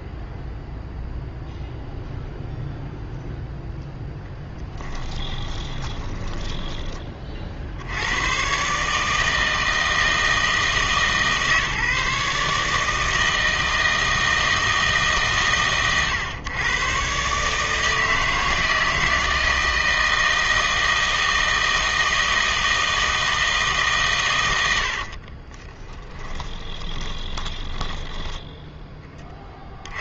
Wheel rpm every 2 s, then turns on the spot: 0, 0, 10, 20, 140, 160, 150, 160, 130, 160, 160, 160, 80, 20, 10.
4-6 26-28